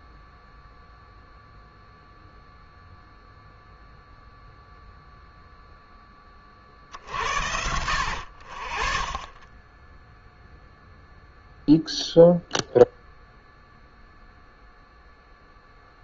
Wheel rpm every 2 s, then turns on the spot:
0, 0, 0, 40, 40, 0, 0, 0.
none